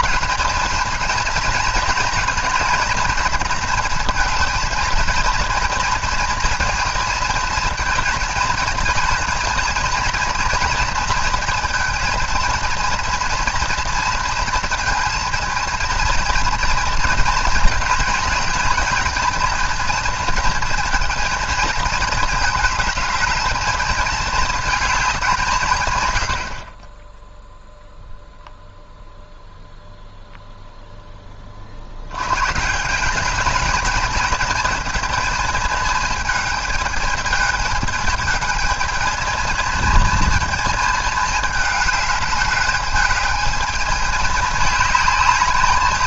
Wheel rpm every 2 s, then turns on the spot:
220, 230, 220, 230, 230, 230, 230, 230, 230, 220, 230, 220, 220, 70, 0, 0, 120, 220, 220, 220, 220, 210, 210.
none